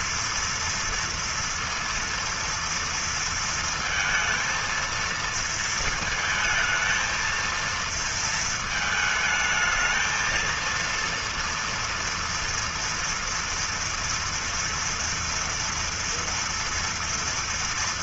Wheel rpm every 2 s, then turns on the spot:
230, 230, 220, 220, 230, 220, 230, 230, 230.
none